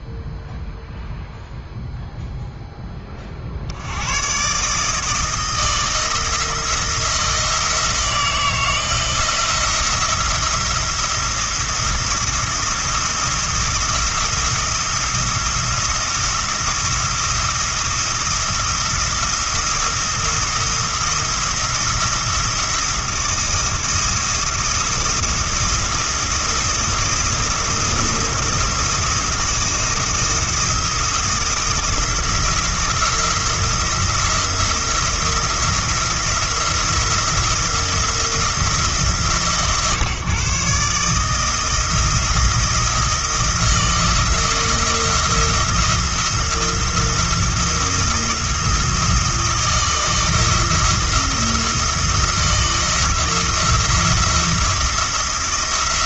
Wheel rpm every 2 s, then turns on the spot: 0, 10, 150, 170, 170, 170, 170, 170, 170, 170, 170, 170, 170, 170, 170, 170, 160, 170, 170, 160, 150, 170, 170, 170, 170, 170, 160, 170.
none